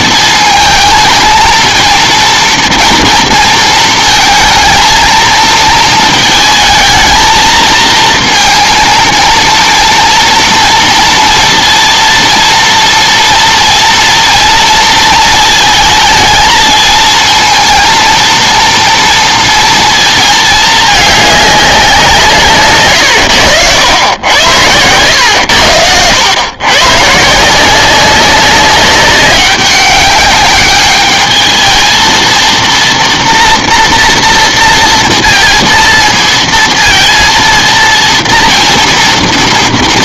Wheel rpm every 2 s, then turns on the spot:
220, 230, 220, 220, 230, 230, 230, 230, 220, 230, 210, 130, 100, 120, 190, 210, 230, 230, 230, 230.
22-24